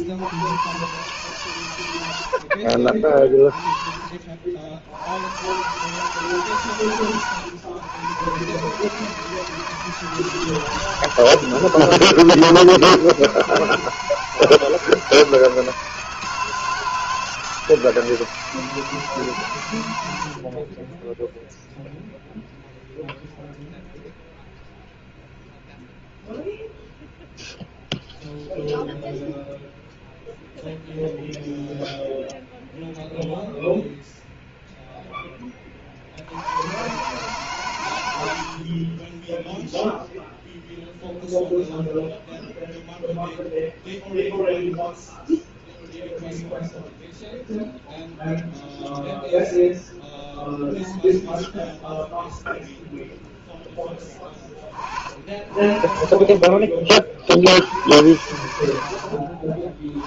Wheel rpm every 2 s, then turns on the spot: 120, 50, 60, 130, 140, 160, 160, 160, 160, 160, 30, 0, 0, 0, 0, 0, 0, 0, 110, 50, 0, 0, 0, 0, 0, 0, 0, 30, 40, 80.
38-40